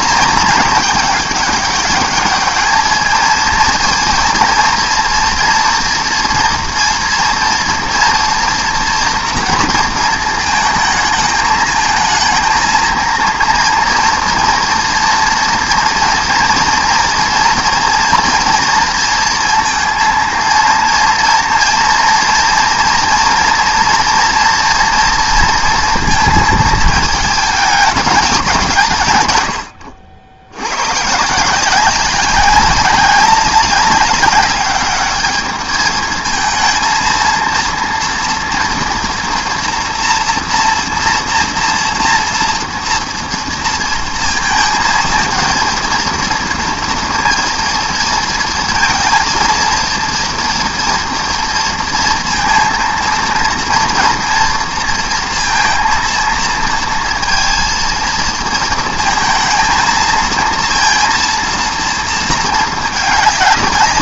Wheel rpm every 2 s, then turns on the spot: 220, 210, 230, 230, 230, 220, 230, 230, 230, 230, 230, 230, 230, 220, 170, 100, 200, 210, 230, 230, 230, 230, 230, 230, 230, 230, 230, 230, 230, 230, 230, 210.
none